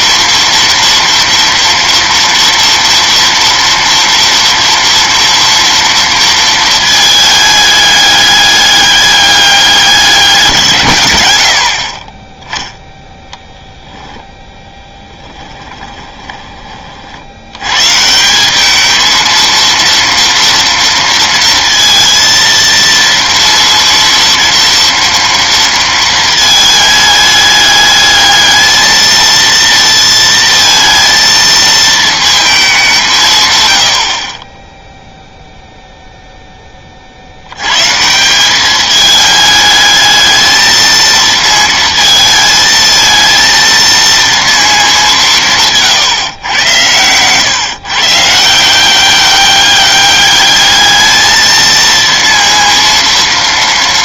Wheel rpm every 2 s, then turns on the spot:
230, 230, 240, 230, 200, 150, 10, 10, 30, 190, 230, 230, 230, 220, 220, 230, 210, 20, 10, 190, 220, 220, 220, 120, 170, 210, 230.
none